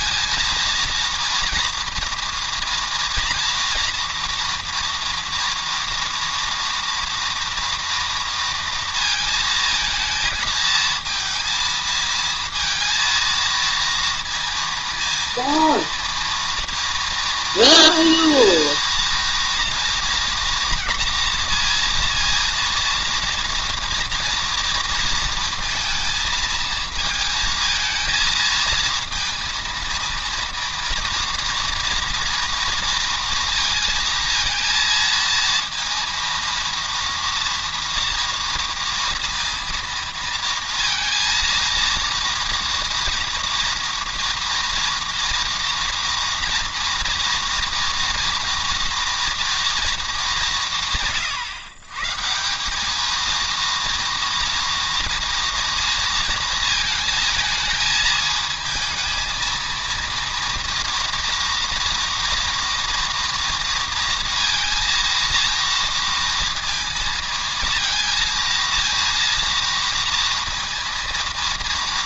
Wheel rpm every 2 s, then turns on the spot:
230, 230, 230, 230, 230, 230, 230, 230, 230, 230, 230, 230, 230, 220, 230, 230, 230, 230, 230, 230, 230, 240, 230, 230, 230, 150, 200, 230, 220, 220, 230, 230, 230, 230, 230, 230.
none